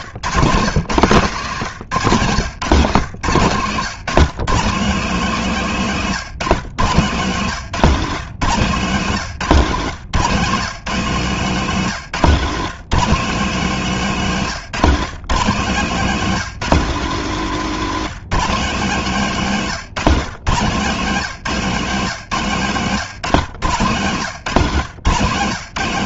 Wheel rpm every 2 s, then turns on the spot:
160, 150, 170, 150, 160, 160, 170, 160, 200, 180, 150, 160, 150.
none